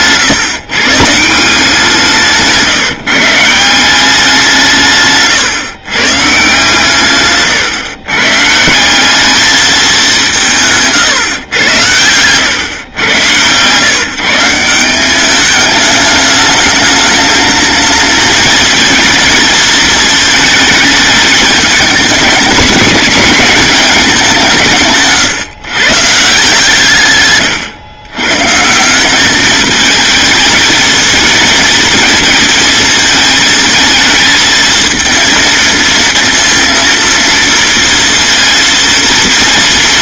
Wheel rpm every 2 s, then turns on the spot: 150, 160, 160, 130, 190, 150, 110, 180, 220, 230, 220, 220, 150, 140, 180, 220, 230, 230, 230, 230.
none